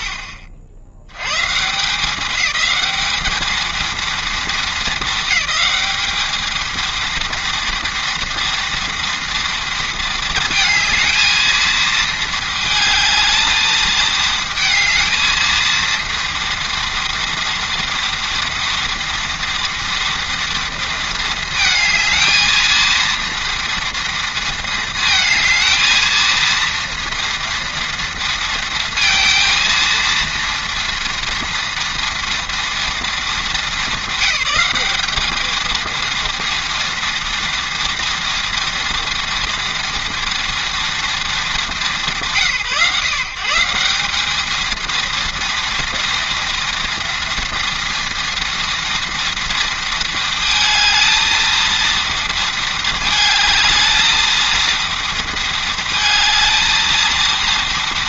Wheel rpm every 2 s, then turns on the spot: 80, 220, 210, 230, 230, 230, 220, 220, 230, 230, 220, 230, 220, 230, 230, 230, 210, 220, 230, 230, 230, 160, 230, 230, 230, 230, 220, 230, 230.
none